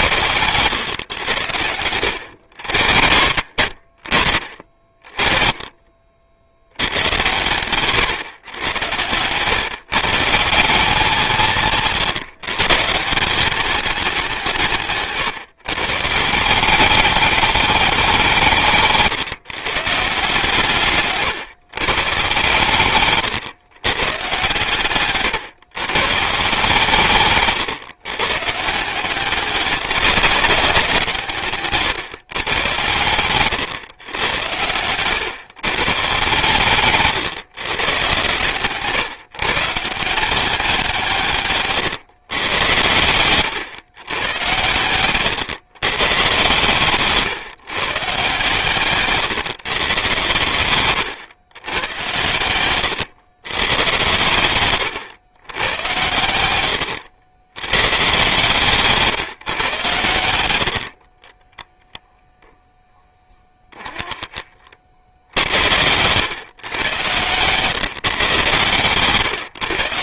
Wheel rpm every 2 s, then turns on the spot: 120, 80, 50, 90, 110, 170, 150, 150, 180, 170, 150, 130, 120, 150, 150, 190, 130, 100, 130, 130, 180, 110, 110, 140, 140, 120, 110, 120, 100, 140, 70, 0, 40, 120, 130.
38-40 44-46 52-54 56-58 60-62